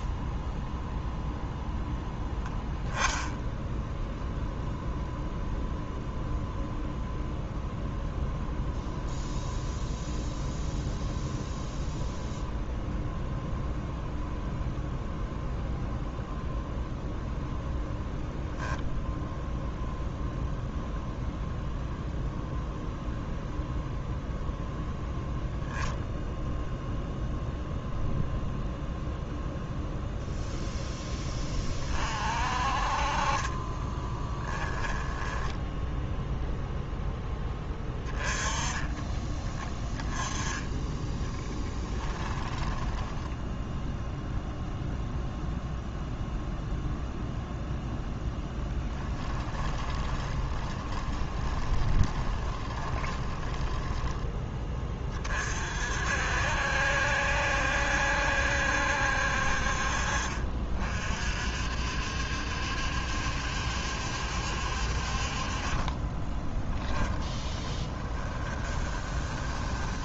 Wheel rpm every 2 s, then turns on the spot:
0, 10, 0, 0, 0, 0, 0, 0, 0, 0, 0, 0, 0, 0, 0, 0, 40, 10, 0, 20, 10, 10, 0, 0, 10, 20, 20, 20, 70, 70, 50, 70, 60, 10, 20.
34-36 42-44 48-54 66-70